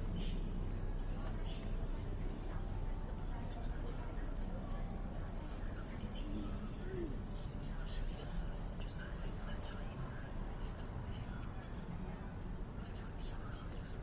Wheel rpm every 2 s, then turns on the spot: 0, 0, 0, 0, 0, 0, 0.
none